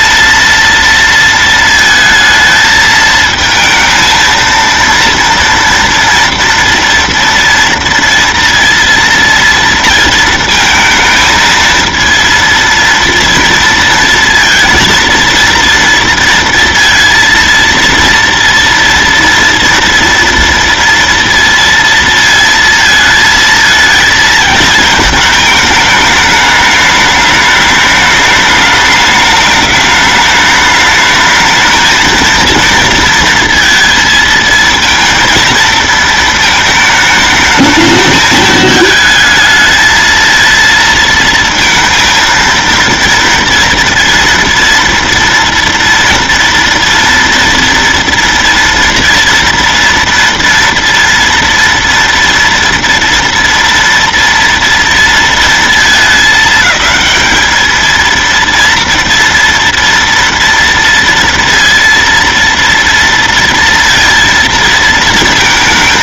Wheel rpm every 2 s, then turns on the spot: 230, 220, 230, 230, 230, 230, 230, 230, 230, 230, 230, 230, 220, 210, 210, 210, 230, 230, 220, 220, 230, 230, 230, 230, 230, 230, 230, 230, 210, 230, 230, 230, 230.
none